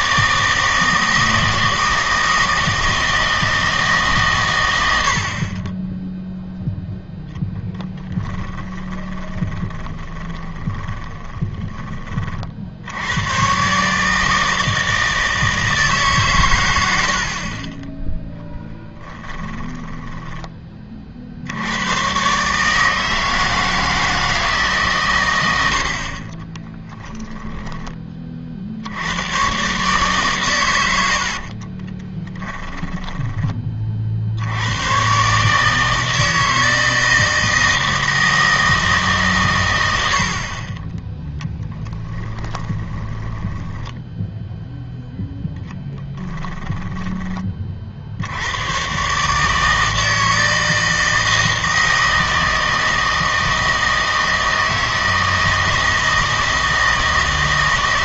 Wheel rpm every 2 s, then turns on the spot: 160, 160, 110, 0, 10, 10, 50, 160, 110, 10, 20, 150, 150, 20, 60, 110, 10, 100, 160, 160, 40, 20, 0, 10, 100, 160, 160, 160, 160.
8-12 18-20 26-28 32-34 42-44 46-48